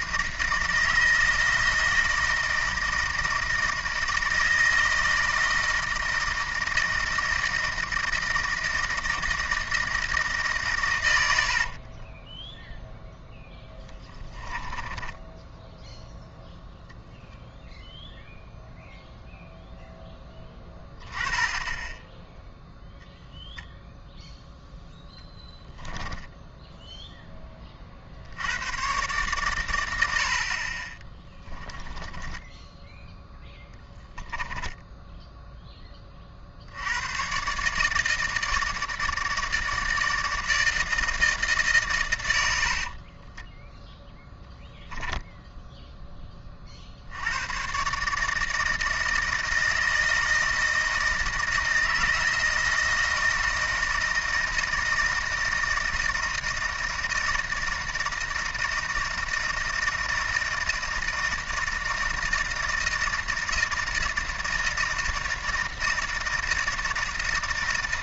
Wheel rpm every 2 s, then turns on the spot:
160, 160, 160, 160, 160, 140, 0, 10, 0, 0, 10, 0, 0, 10, 100, 40, 10, 10, 60, 160, 160, 70, 10, 40, 160, 160, 160, 160, 160, 160, 170, 160, 160, 160.
14-16 26-28 34-36 42-44